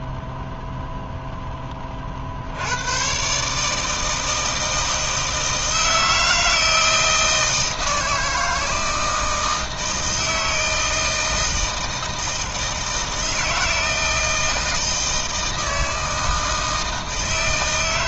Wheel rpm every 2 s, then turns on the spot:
0, 100, 160, 160, 160, 160, 160, 160, 160.
none